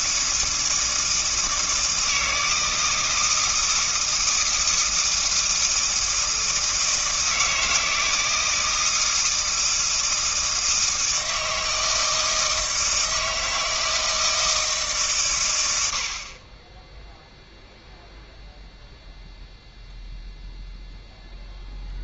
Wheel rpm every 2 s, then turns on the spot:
160, 160, 160, 160, 160, 160, 160, 150, 10, 0, 0.
none